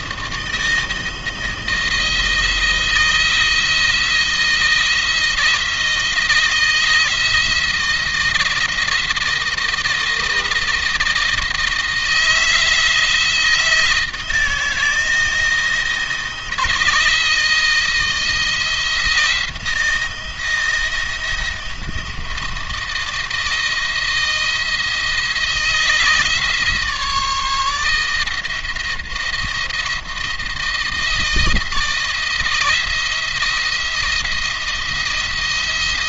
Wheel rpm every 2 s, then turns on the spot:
160, 160, 160, 160, 170, 160, 160, 160, 160, 160, 170, 170, 170, 160, 170, 170, 160, 170.
none